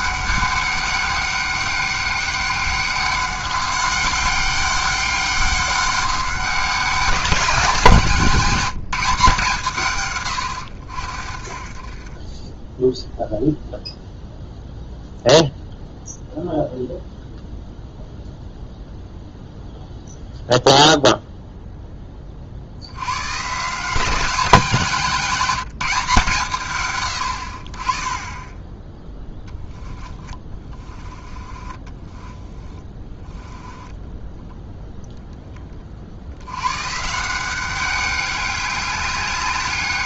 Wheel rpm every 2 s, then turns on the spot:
200, 200, 200, 190, 190, 80, 10, 0, 0, 0, 0, 70, 190, 140, 10, 20, 10, 0, 120, 200.
30-34